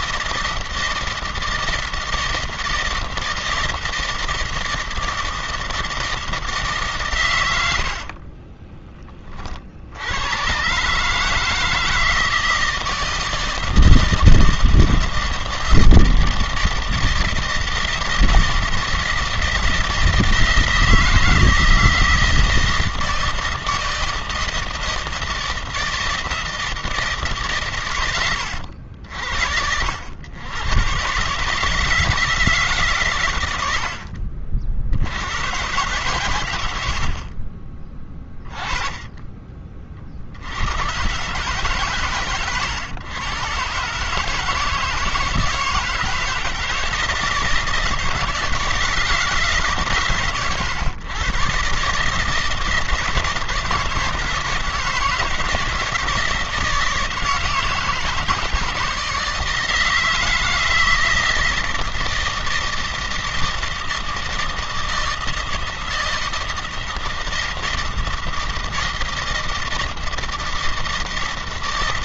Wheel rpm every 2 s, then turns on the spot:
160, 160, 160, 160, 30, 120, 160, 160, 160, 160, 160, 160, 160, 160, 90, 110, 150, 60, 120, 20, 100, 120, 150, 160, 160, 120, 160, 160, 160, 160, 160, 160, 160, 160, 160, 160.
8-10